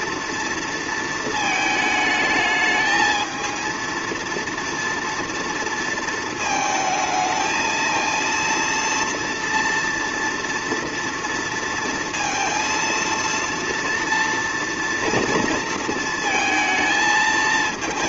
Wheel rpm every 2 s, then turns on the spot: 230, 220, 230, 220, 230, 230, 230, 230, 230.
none